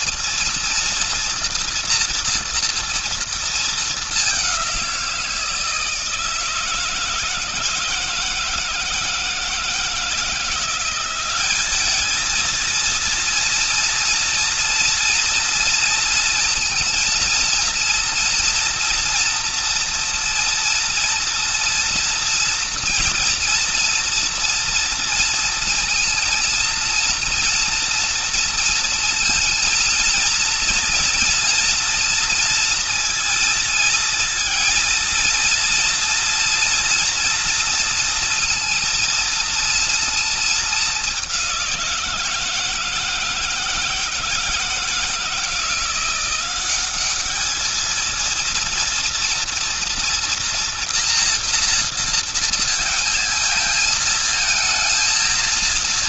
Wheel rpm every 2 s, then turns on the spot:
230, 240, 200, 160, 160, 170, 220, 230, 230, 230, 230, 230, 230, 230, 230, 230, 230, 230, 230, 230, 220, 170, 160, 180, 230, 230, 230, 220.
none